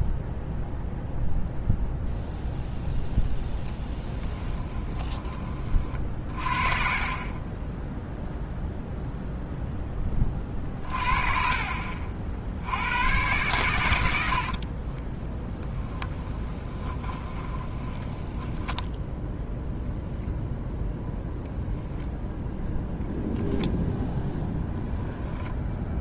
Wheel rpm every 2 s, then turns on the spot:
0, 0, 20, 30, 0, 40, 90, 30, 20, 10, 0, 0, 0.
4-6 10-12 14-20